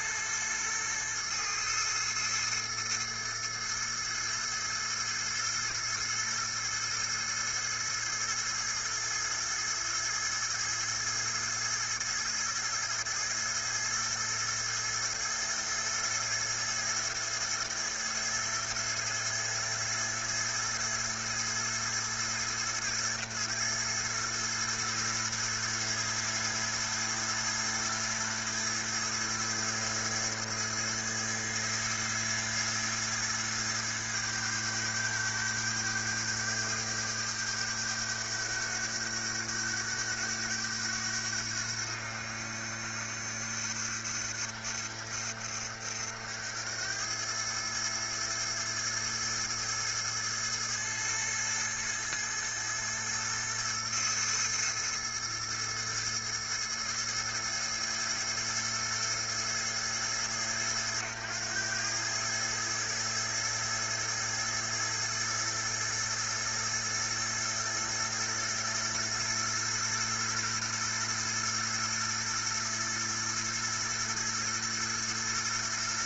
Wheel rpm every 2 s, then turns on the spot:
110, 110, 110, 110, 110, 110, 110, 110, 110, 110, 110, 110, 110, 110, 110, 110, 110, 100, 100, 100, 90, 70, 70, 100, 110, 110, 110, 110, 110, 110, 100, 110, 110, 110, 120, 120, 120, 120.
none